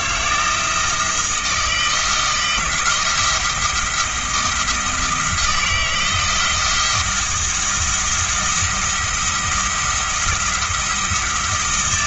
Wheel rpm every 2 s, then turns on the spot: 160, 170, 160, 170, 170, 170.
none